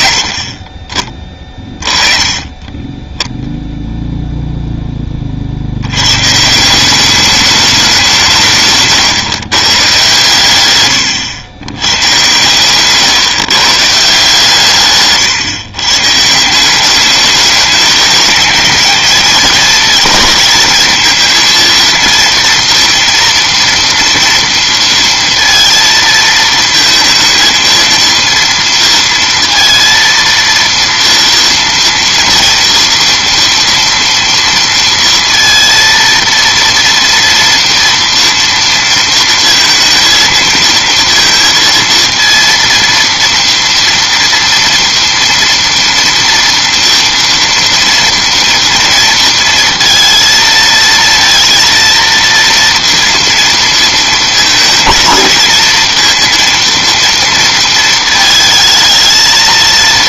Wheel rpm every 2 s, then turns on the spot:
20, 20, 0, 170, 140, 120, 120, 140, 180, 220, 220, 230, 230, 220, 230, 230, 230, 230, 230, 230, 230, 230, 230, 230, 230, 230, 230, 220, 230, 220.
8-10